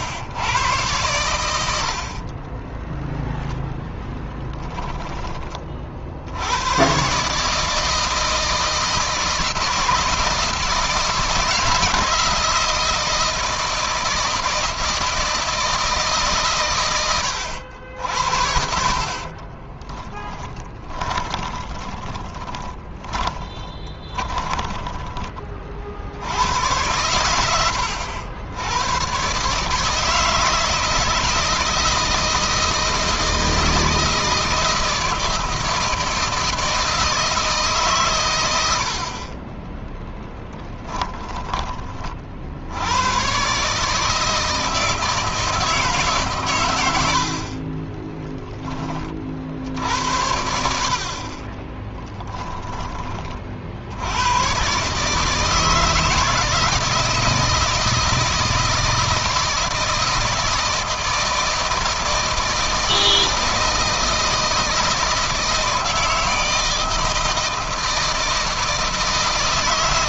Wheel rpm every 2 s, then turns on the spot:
100, 10, 10, 120, 160, 160, 160, 160, 110, 50, 30, 20, 20, 100, 120, 160, 160, 160, 160, 60, 10, 90, 160, 90, 20, 50, 20, 140, 160, 160, 160, 160, 160, 160, 160.
4-6 18-24